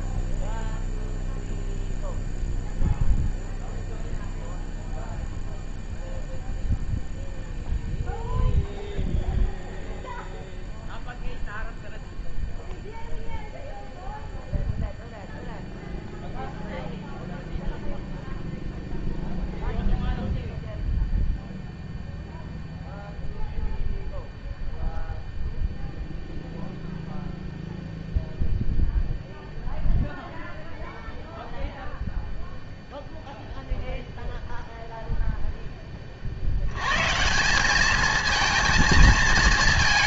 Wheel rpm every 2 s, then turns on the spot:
0, 0, 0, 0, 0, 0, 0, 0, 0, 0, 0, 0, 0, 0, 0, 0, 0, 0, 70, 220.
none